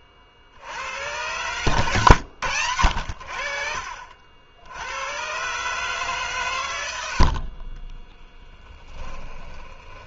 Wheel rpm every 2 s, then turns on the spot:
60, 100, 80, 100, 10.
8-10